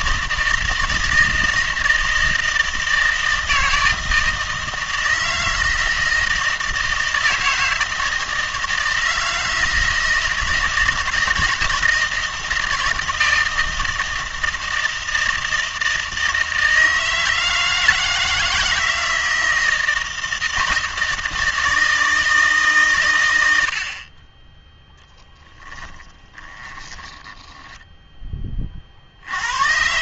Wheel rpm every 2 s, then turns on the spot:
160, 160, 160, 160, 160, 160, 160, 160, 160, 160, 160, 140, 10, 20, 30.
26-28